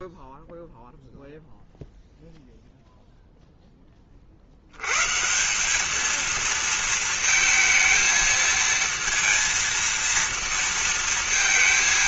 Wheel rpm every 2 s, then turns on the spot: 0, 0, 80, 230, 230, 230.
none